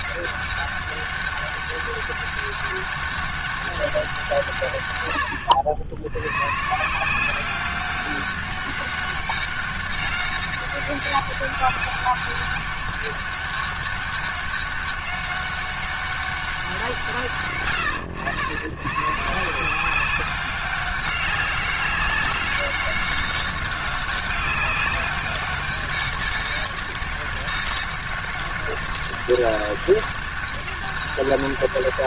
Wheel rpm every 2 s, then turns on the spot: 200, 200, 170, 110, 200, 200, 200, 200, 190, 100, 190, 200, 200, 200, 200, 200.
none